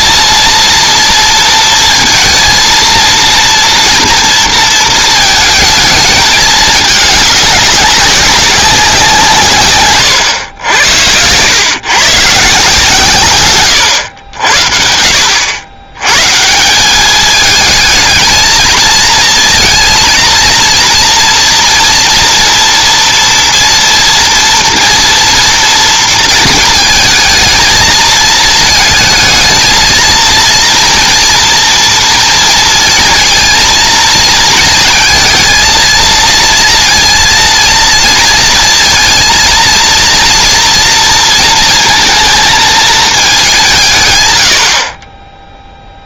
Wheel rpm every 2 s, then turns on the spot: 230, 230, 230, 210, 190, 100, 140, 60, 180, 220, 230, 230, 240, 230, 220, 230, 230, 230, 230, 230, 240, 220, 80.
none